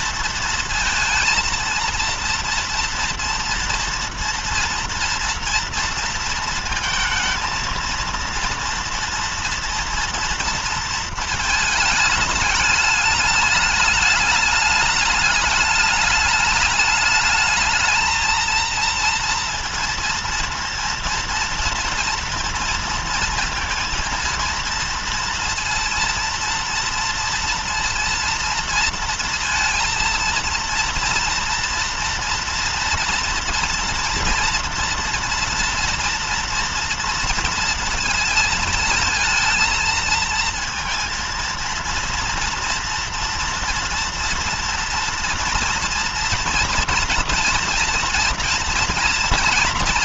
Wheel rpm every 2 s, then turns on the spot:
230, 230, 240, 230, 230, 230, 210, 210, 210, 230, 230, 230, 230, 230, 230, 230, 230, 230, 240, 220, 230, 230, 230, 230, 230.
none